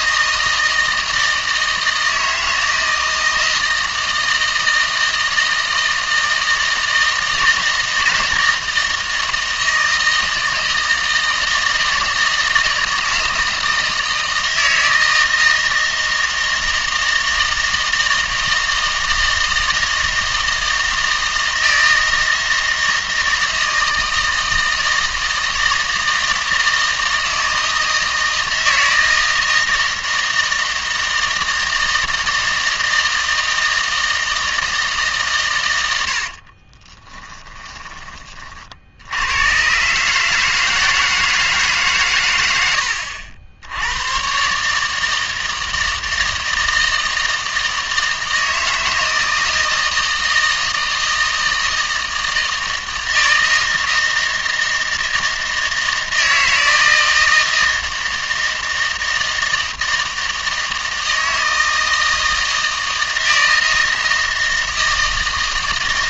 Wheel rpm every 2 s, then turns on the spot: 160, 160, 160, 160, 160, 160, 160, 160, 160, 160, 160, 160, 160, 160, 160, 160, 160, 160, 40, 50, 160, 80, 150, 160, 160, 160, 160, 160, 160, 160, 160, 160, 160.
36-38